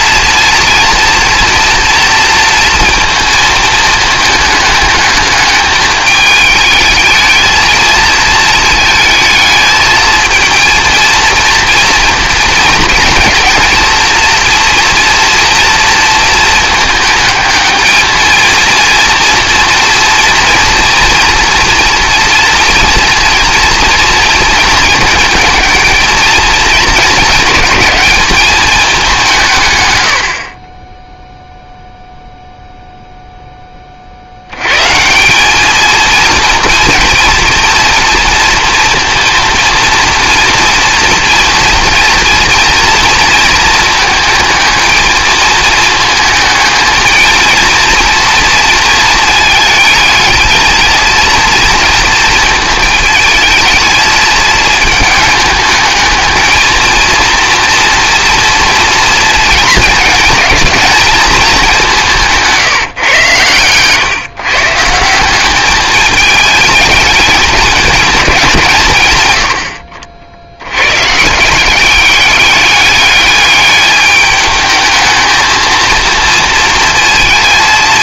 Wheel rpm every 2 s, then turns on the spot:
240, 230, 210, 210, 220, 220, 230, 230, 220, 230, 230, 230, 220, 220, 210, 10, 0, 120, 230, 230, 230, 230, 220, 220, 220, 220, 220, 220, 220, 230, 220, 150, 150, 210, 160, 100, 200, 210, 230.
none